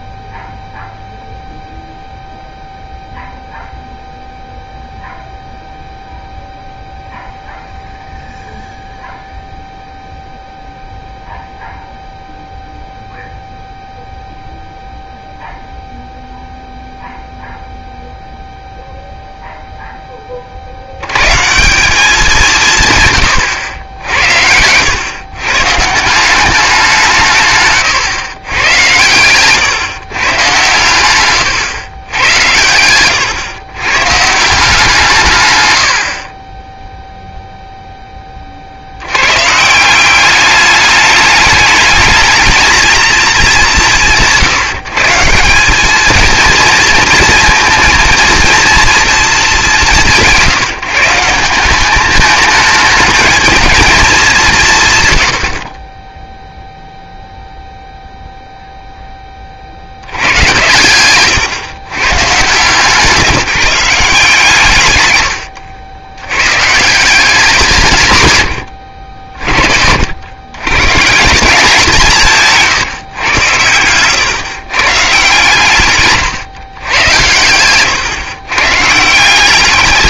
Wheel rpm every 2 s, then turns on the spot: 0, 0, 0, 0, 0, 0, 0, 0, 0, 0, 50, 160, 90, 190, 120, 110, 100, 160, 10, 40, 210, 220, 170, 230, 230, 180, 210, 180, 0, 0, 110, 150, 160, 150, 110, 120, 150, 130, 120, 130.
68-70